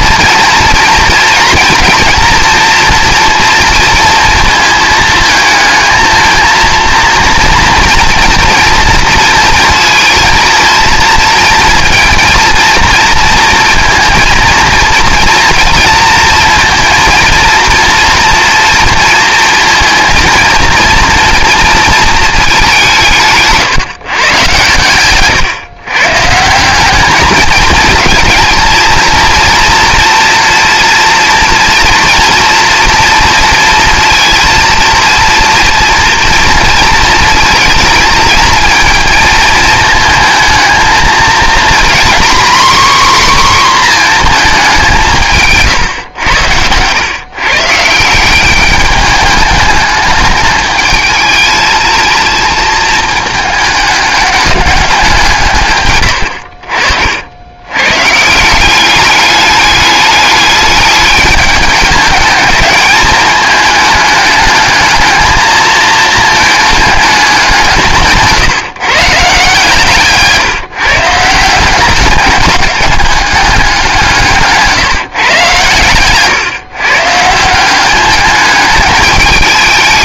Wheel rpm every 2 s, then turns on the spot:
240, 240, 220, 230, 230, 230, 230, 230, 230, 230, 230, 190, 120, 180, 230, 230, 240, 230, 230, 230, 220, 260, 190, 100, 200, 220, 220, 200, 60, 190, 210, 210, 220, 210, 140, 150, 200, 150, 140, 210.
none